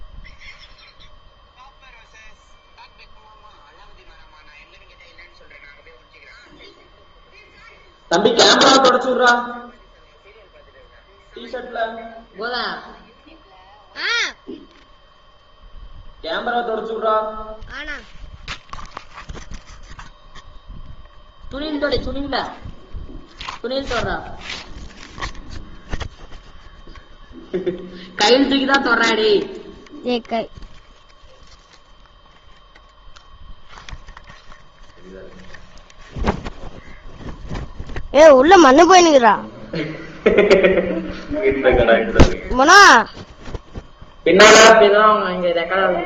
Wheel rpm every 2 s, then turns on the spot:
0, 0, 0, 0, 0, 0, 0, 0, 0, 0, 0, 0, 0, 0, 0, 0, 0, 0, 0, 0, 0, 0, 0.
none